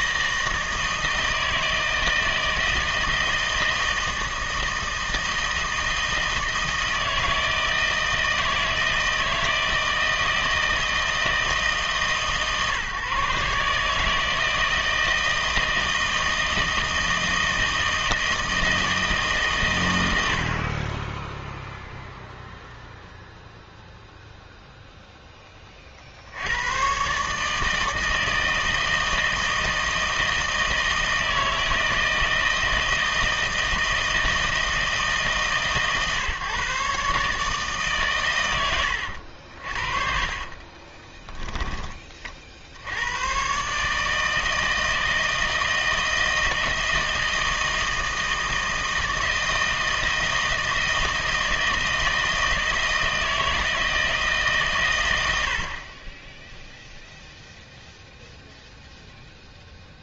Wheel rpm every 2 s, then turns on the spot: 160, 160, 160, 160, 160, 160, 140, 160, 160, 160, 60, 0, 0, 90, 160, 160, 160, 160, 140, 110, 40, 60, 160, 160, 160, 160, 160, 140, 0, 0.
40-42